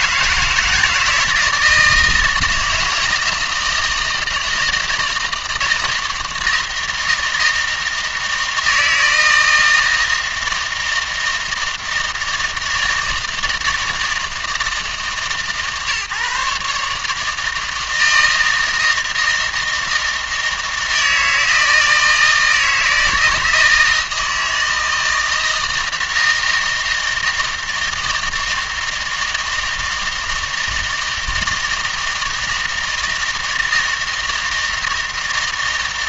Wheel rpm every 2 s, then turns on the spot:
160, 160, 160, 160, 160, 160, 160, 160, 150, 160, 160, 160, 160, 160, 160, 160, 160, 160.
none